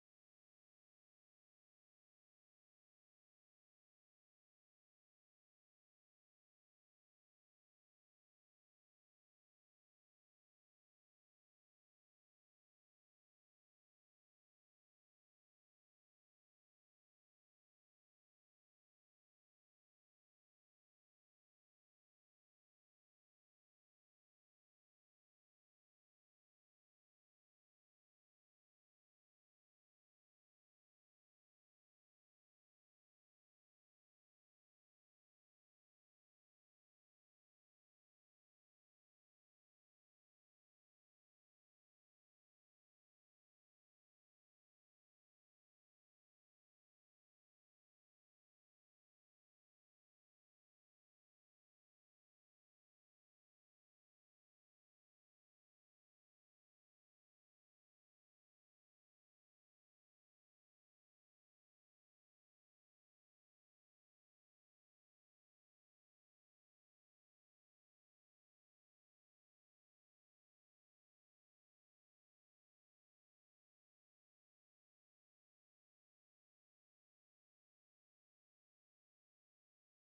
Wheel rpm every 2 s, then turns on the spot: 0, 0, 0, 0, 0, 0, 0, 0, 0, 0, 0, 0, 0, 0, 0, 0, 0, 0, 0, 0, 0, 0, 0, 0, 0, 0, 0, 0, 0, 0, 0, 0, 0, 0, 0, 0, 0, 0, 0, 0.
none